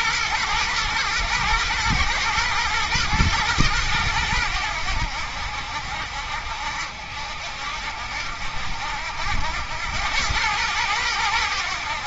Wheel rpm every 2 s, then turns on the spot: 110, 110, 80, 60, 80, 100.
none